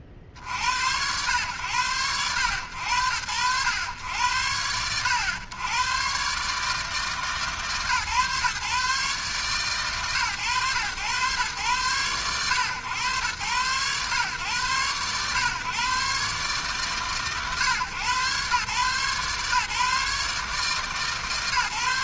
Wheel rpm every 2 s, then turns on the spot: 50, 90, 80, 140, 140, 110, 110, 120, 140, 130, 140.
none